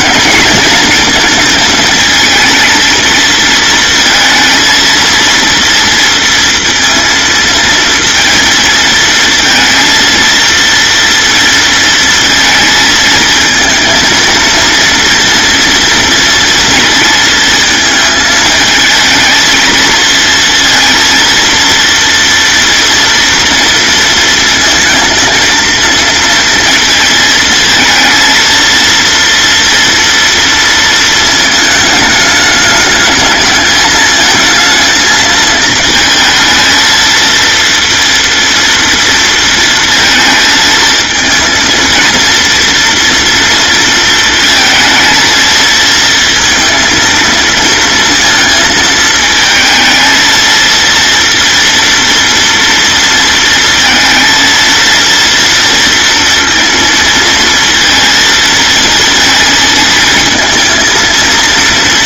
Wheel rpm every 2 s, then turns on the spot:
220, 230, 230, 230, 230, 230, 220, 230, 230, 220, 230, 240, 230, 230, 230, 230, 210, 220, 230, 230, 220, 230, 220, 230, 220, 230, 230, 230, 230, 220, 220.
none